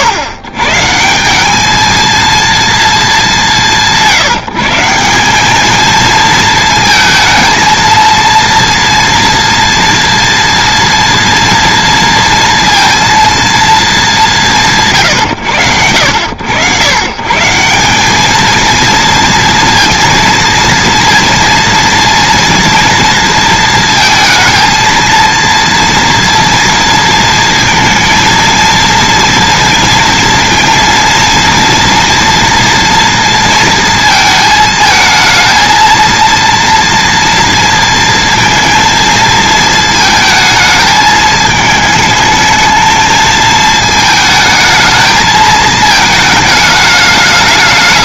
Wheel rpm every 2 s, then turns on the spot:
130, 220, 170, 230, 230, 230, 230, 160, 100, 230, 230, 230, 230, 230, 230, 230, 230, 220, 230, 230, 220, 220, 220, 220.
none